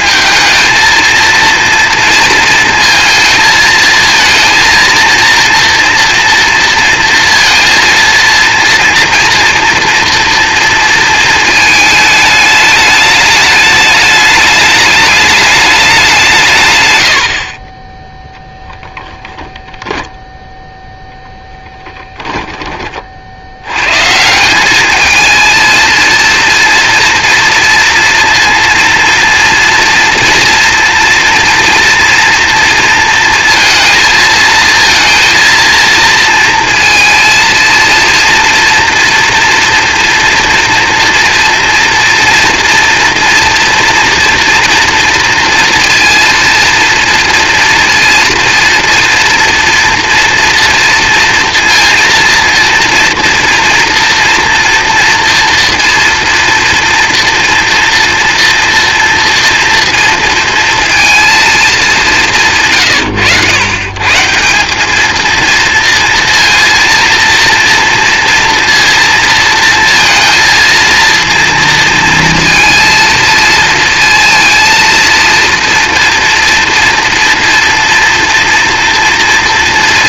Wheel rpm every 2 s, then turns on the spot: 220, 230, 230, 230, 240, 230, 210, 210, 120, 0, 0, 20, 190, 230, 230, 230, 230, 230, 230, 230, 230, 230, 230, 230, 230, 230, 230, 240, 240, 230, 230, 130, 190, 230, 230, 230, 230, 230, 230, 230.
62-64